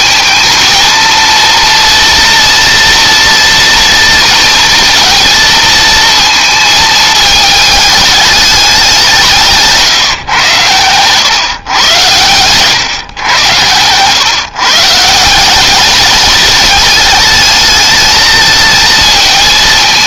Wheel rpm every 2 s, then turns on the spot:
220, 230, 230, 220, 190, 120, 120, 150, 210, 220.
none